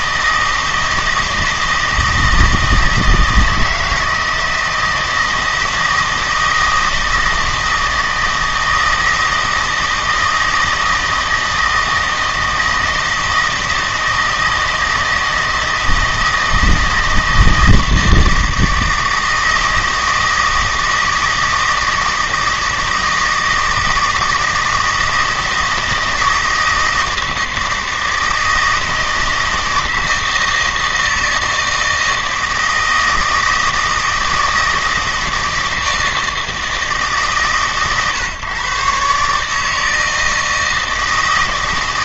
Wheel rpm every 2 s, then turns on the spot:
160, 160, 160, 160, 160, 160, 160, 160, 160, 160, 160, 160, 160, 160, 160, 160, 160, 160, 150, 130, 160.
none